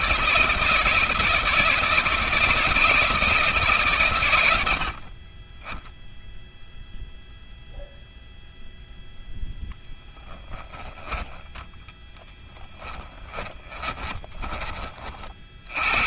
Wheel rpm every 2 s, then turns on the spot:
160, 160, 60, 0, 0, 10, 20, 40.
12-14